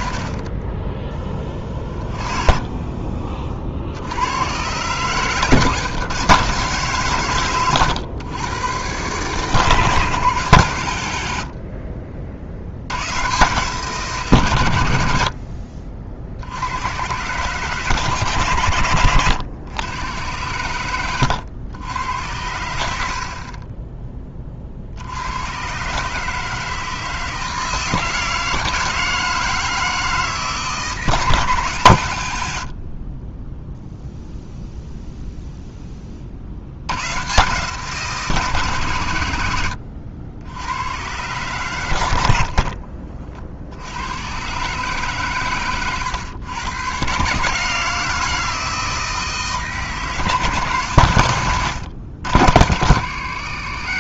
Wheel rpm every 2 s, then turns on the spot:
10, 30, 130, 140, 120, 110, 100, 70, 100, 100, 100, 70, 70, 160, 160, 160, 40, 0, 100, 130, 110, 50, 130, 120, 160, 130, 90.
18-20 32-34 42-44